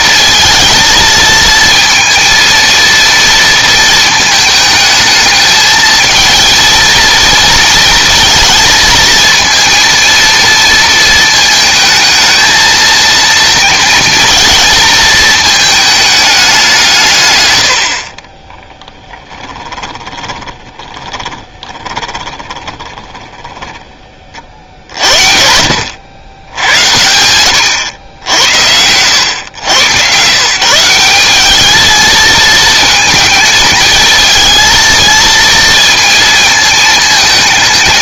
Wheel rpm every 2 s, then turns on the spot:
230, 230, 220, 230, 230, 230, 230, 230, 190, 10, 20, 20, 60, 100, 90, 150, 220, 230, 230.
18-24